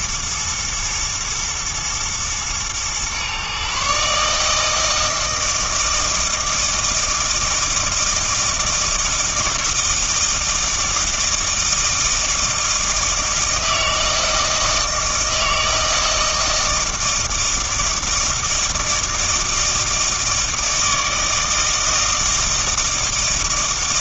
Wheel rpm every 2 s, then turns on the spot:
110, 120, 160, 160, 160, 160, 160, 160, 160, 160, 160, 160.
none